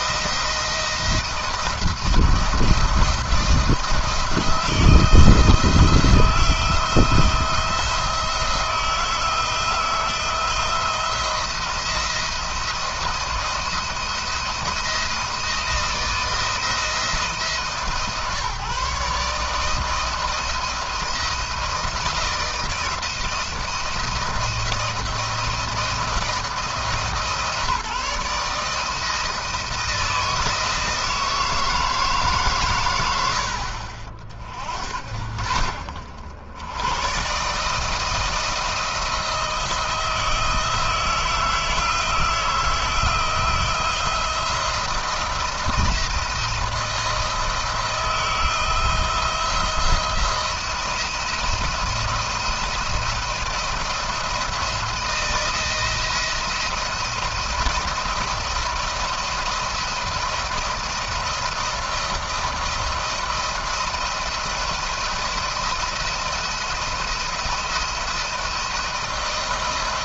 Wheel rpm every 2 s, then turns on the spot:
160, 170, 160, 170, 160, 170, 160, 170, 170, 150, 170, 170, 170, 170, 160, 160, 130, 60, 90, 170, 160, 160, 160, 160, 170, 170, 170, 160, 170, 170, 170, 170, 170, 170, 170.
none